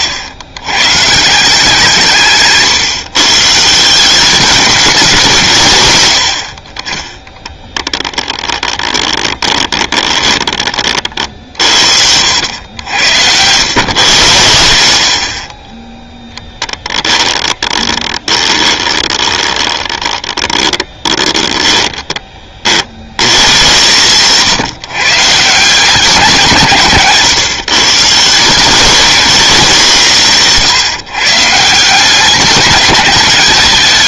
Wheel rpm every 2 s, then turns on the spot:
120, 150, 190, 30, 10, 40, 90, 80, 20, 20, 10, 60, 140, 150, 190, 150, 210.
8-10 16-22